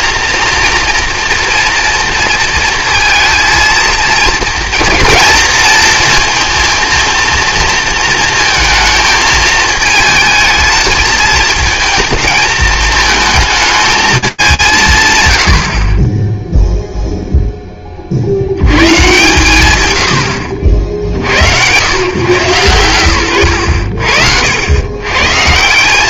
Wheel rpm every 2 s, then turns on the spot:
230, 230, 230, 230, 220, 220, 220, 190, 0, 110, 70, 110, 90.
none